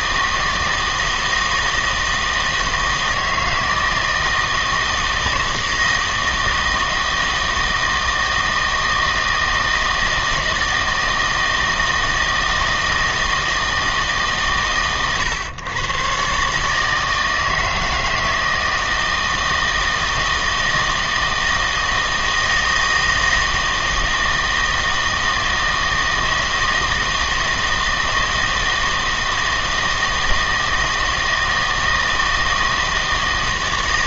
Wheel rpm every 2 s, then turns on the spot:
160, 160, 160, 160, 160, 160, 160, 140, 140, 160, 160, 160, 160, 160, 160, 160, 160.
none